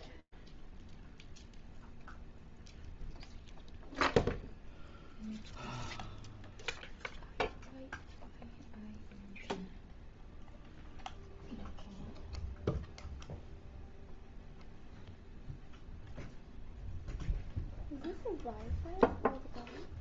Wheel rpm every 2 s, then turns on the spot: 0, 0, 0, 0, 0, 0, 0, 0, 0, 0.
none